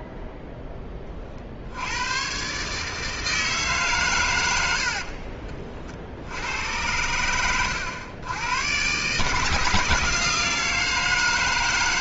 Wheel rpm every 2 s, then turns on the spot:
10, 140, 70, 90, 120, 160.
none